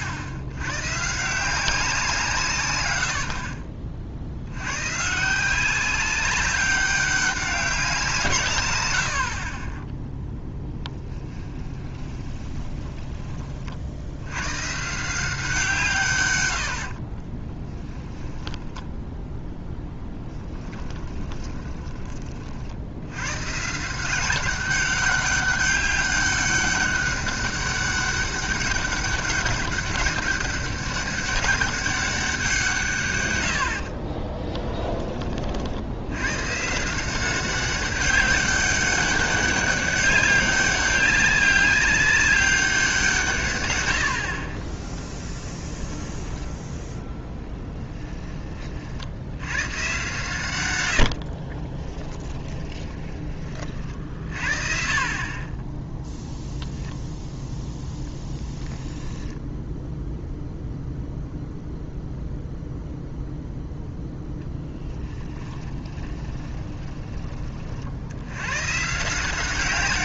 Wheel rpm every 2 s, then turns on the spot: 100, 130, 100, 190, 110, 10, 20, 130, 80, 10, 10, 60, 190, 200, 200, 200, 160, 10, 140, 200, 200, 190, 30, 10, 30, 100, 20, 40, 0, 10, 0, 0, 0, 10, 120.
10-14 18-22 52-54 66-68